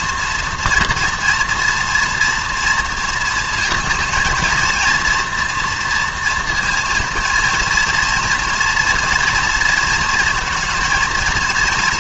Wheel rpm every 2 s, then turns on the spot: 240, 230, 230, 230, 230, 230.
none